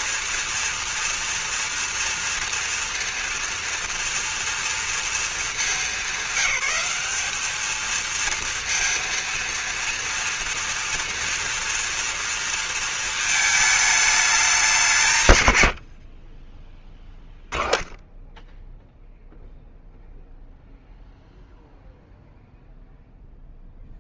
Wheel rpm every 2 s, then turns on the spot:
230, 230, 230, 210, 230, 230, 230, 180, 10, 0, 0, 0.
none